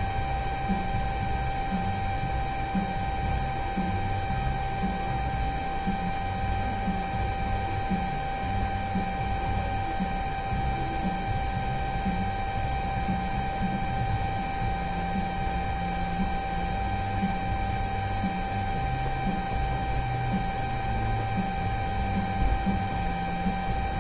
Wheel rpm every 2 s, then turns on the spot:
0, 0, 0, 0, 0, 0, 0, 0, 0, 0, 0, 0.
none